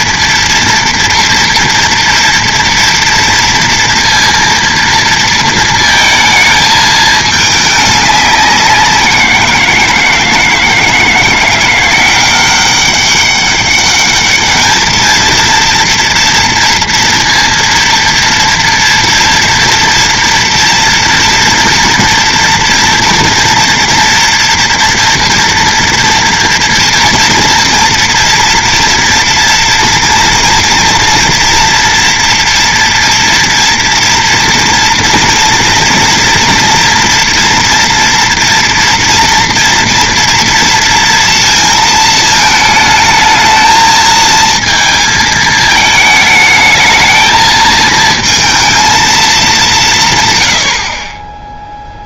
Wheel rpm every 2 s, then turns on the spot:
230, 230, 230, 220, 190, 160, 190, 210, 230, 230, 230, 230, 230, 230, 230, 240, 230, 230, 230, 230, 230, 220, 220, 220, 230, 100.
none